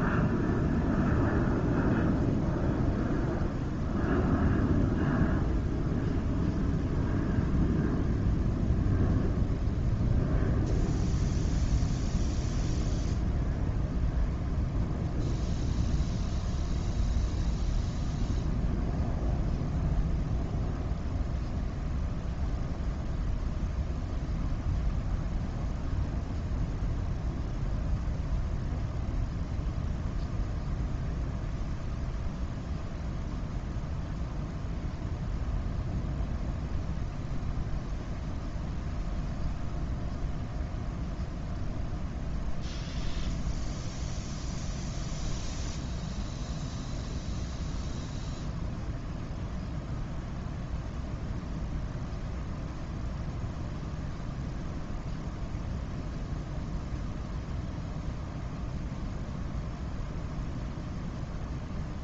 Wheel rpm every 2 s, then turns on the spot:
0, 0, 0, 0, 0, 0, 0, 0, 0, 0, 0, 0, 0, 0, 0, 0, 0, 0, 0, 0, 0, 0, 0, 0, 0, 0, 0, 0, 0, 0, 0.
none